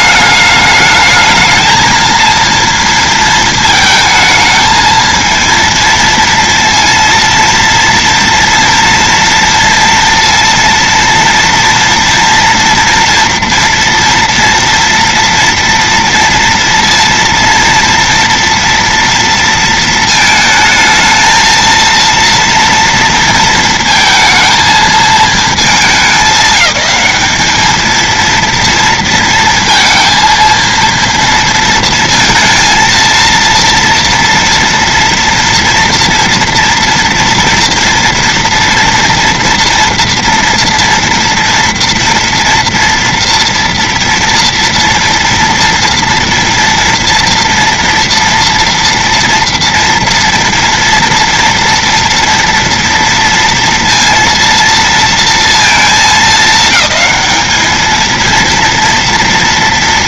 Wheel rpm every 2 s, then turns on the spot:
210, 230, 220, 230, 230, 230, 230, 230, 230, 230, 220, 230, 230, 210, 230, 230, 230, 230, 230, 230, 230, 230, 230, 230, 230, 230, 230, 230, 220, 230.
none